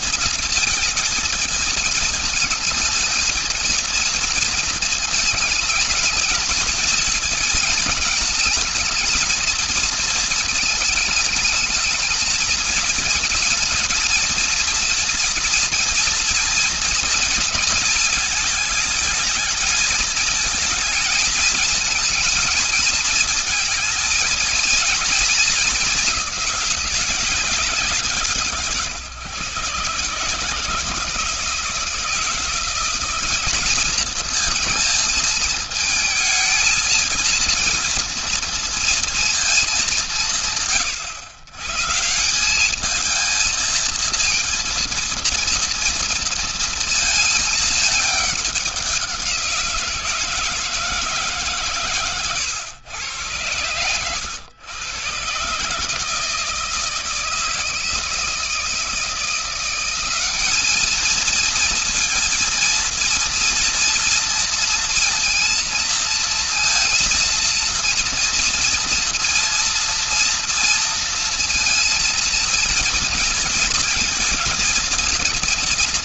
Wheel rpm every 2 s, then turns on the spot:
220, 220, 220, 220, 220, 220, 220, 230, 230, 220, 220, 220, 220, 210, 160, 150, 170, 220, 220, 230, 190, 190, 230, 230, 200, 160, 120, 110, 160, 160, 200, 230, 230, 230, 230, 230, 230, 230.
none